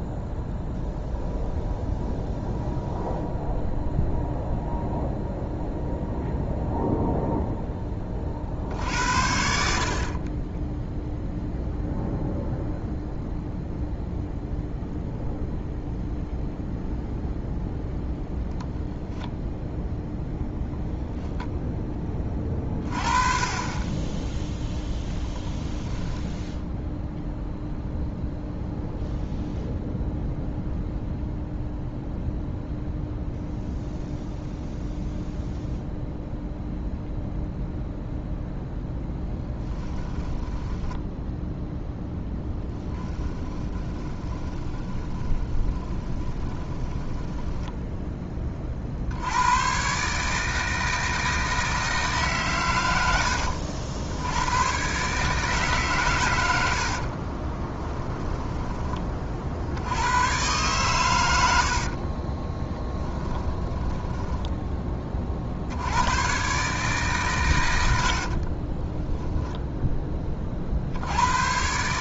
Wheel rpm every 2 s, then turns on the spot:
0, 0, 0, 0, 60, 0, 0, 0, 0, 0, 10, 30, 0, 0, 0, 0, 0, 0, 0, 0, 10, 10, 20, 20, 50, 160, 100, 120, 70, 20, 120, 20, 30, 140, 20, 60.
40-48 56-58 62-64 68-70